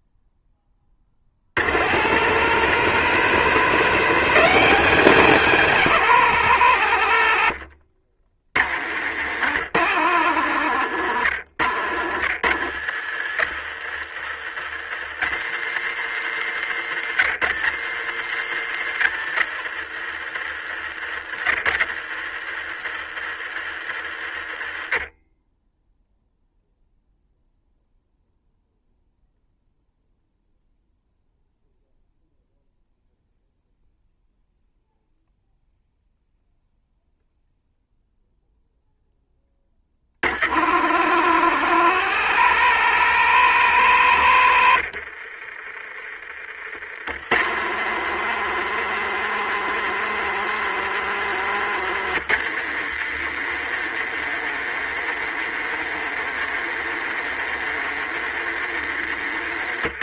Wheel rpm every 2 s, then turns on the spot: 20, 170, 190, 120, 80, 110, 80, 90, 110, 110, 80, 80, 50, 0, 0, 0, 0, 0, 0, 0, 80, 140, 90, 50, 140, 140, 130, 140, 140, 130.
44-46